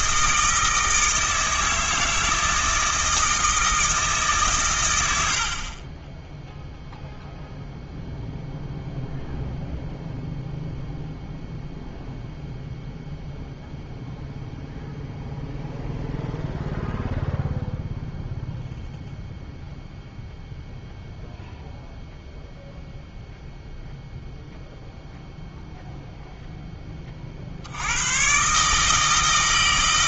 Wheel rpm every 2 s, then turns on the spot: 160, 160, 120, 0, 0, 0, 0, 0, 0, 0, 0, 0, 0, 10, 150.
none